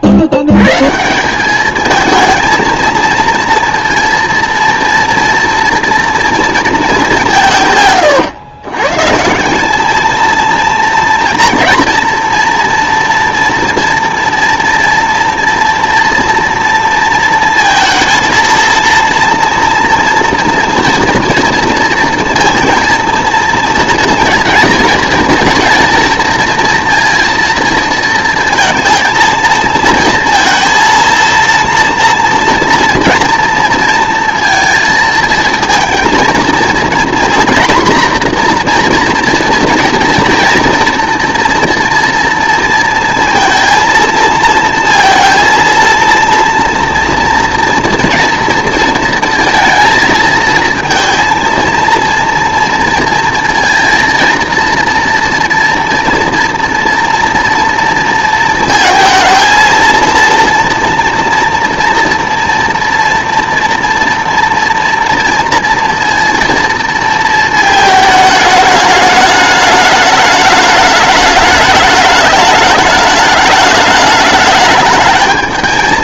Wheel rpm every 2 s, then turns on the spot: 110, 230, 230, 230, 120, 230, 230, 230, 230, 230, 240, 230, 220, 230, 230, 230, 230, 230, 230, 240, 240, 230, 230, 230, 230, 230, 230, 230, 230, 230, 230, 230, 230, 230, 210, 210, 210, 210.
none